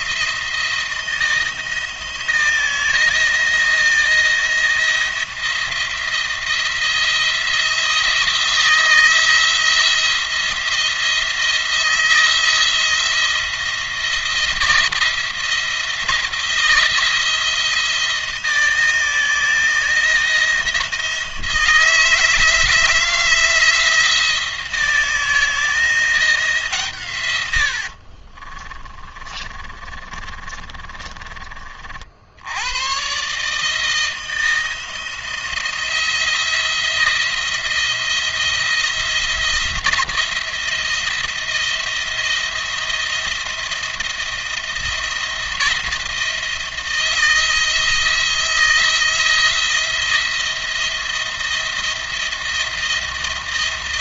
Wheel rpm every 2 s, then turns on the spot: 170, 170, 170, 170, 170, 170, 170, 170, 170, 160, 160, 160, 170, 160, 40, 30, 90, 170, 170, 170, 170, 170, 170, 170, 170, 170, 170.
28-32